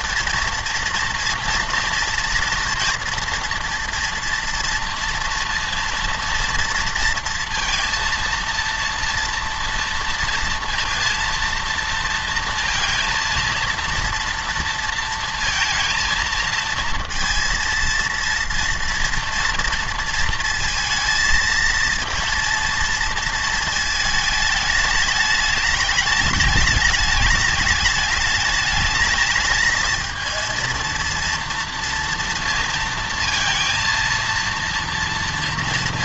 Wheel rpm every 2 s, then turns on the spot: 230, 230, 230, 230, 230, 230, 230, 230, 230, 240, 230, 230, 210, 210, 220, 230, 230, 230.
none